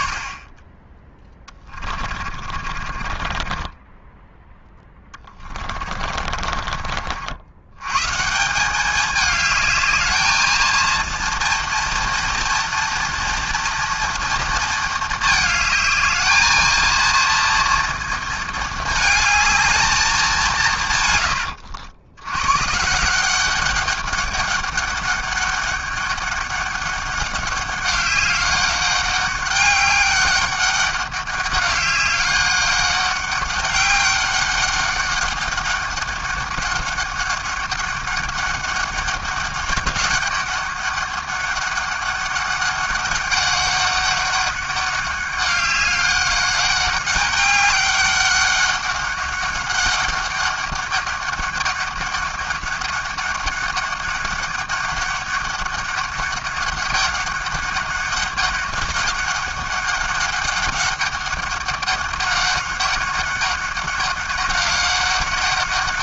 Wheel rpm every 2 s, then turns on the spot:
30, 30, 10, 40, 180, 220, 230, 230, 220, 220, 170, 130, 200, 200, 200, 200, 200, 200, 200, 200, 200, 200, 200, 200, 200, 200, 200, 200, 200, 200, 200, 200, 200.
2-4 6-8